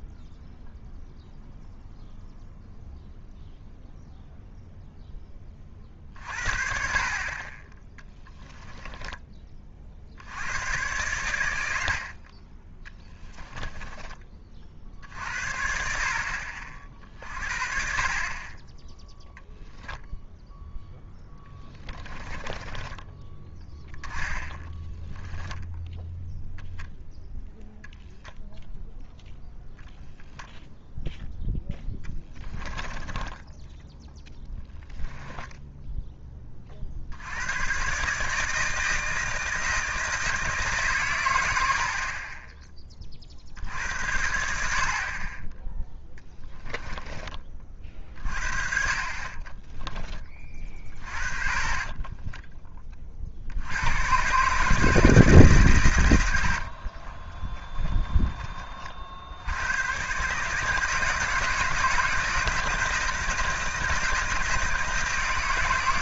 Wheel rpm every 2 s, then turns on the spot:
0, 0, 0, 60, 10, 100, 30, 50, 40, 20, 0, 20, 20, 0, 0, 0, 10, 0, 40, 160, 140, 10, 50, 10, 40, 20, 20, 150, 50, 40, 160, 160, 160.
12-14 24-26 32-34 46-48 56-58